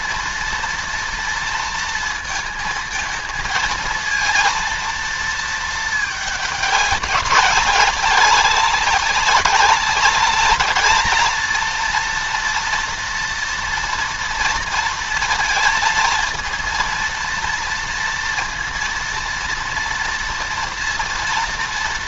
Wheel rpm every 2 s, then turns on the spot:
230, 220, 230, 190, 190, 220, 230, 230, 230, 230, 230.
none